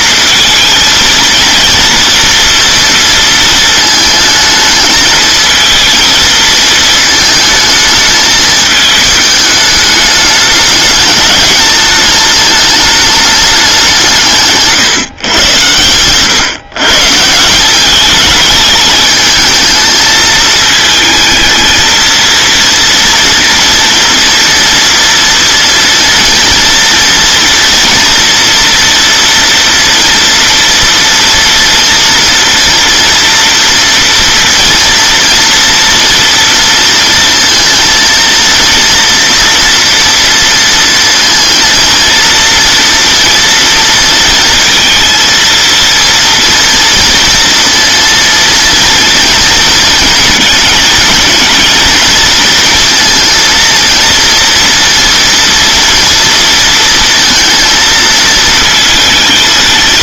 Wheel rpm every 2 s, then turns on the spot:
220, 230, 220, 220, 220, 210, 210, 140, 120, 210, 220, 230, 230, 230, 230, 230, 230, 230, 230, 230, 230, 230, 230, 230, 230, 230, 230, 240, 230, 220.
14-16